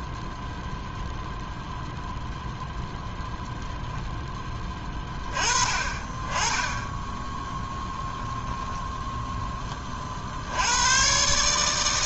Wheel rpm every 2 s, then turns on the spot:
10, 0, 10, 20, 0, 70.
none